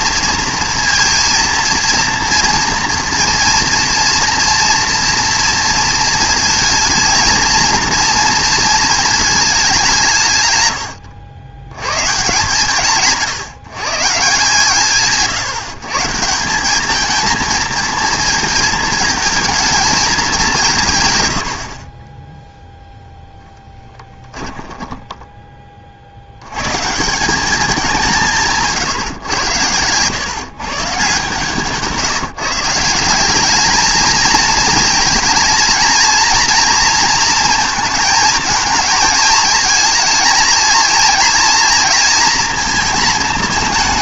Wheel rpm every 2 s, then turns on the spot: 230, 230, 230, 220, 220, 110, 150, 160, 200, 220, 150, 0, 10, 120, 150, 150, 170, 220, 230, 220, 230, 230.
24-26